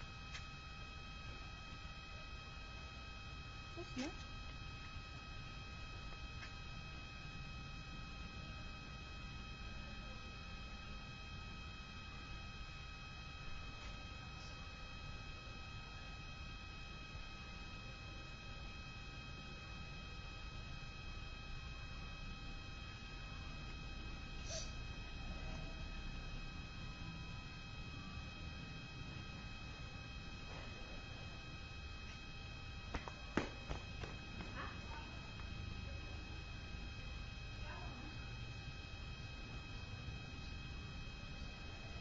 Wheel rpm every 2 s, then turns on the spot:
0, 0, 0, 0, 0, 0, 0, 0, 0, 0, 0, 0, 0, 0, 0, 0, 0, 0, 0, 0, 0.
none